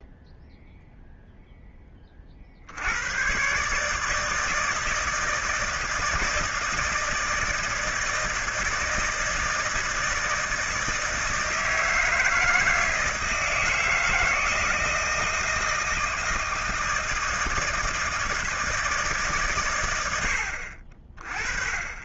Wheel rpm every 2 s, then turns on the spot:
0, 80, 160, 160, 160, 160, 160, 160, 160, 160, 50.
none